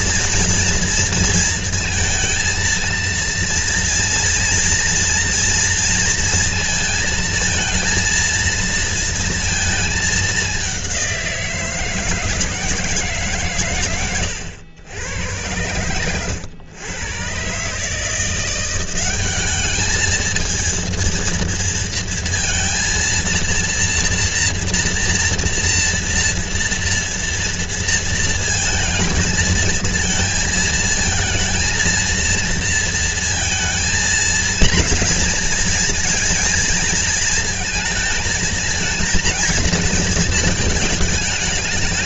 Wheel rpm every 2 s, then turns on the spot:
230, 230, 230, 230, 230, 190, 160, 100, 110, 190, 230, 230, 230, 230, 230, 230, 230, 240, 230, 220, 220.
none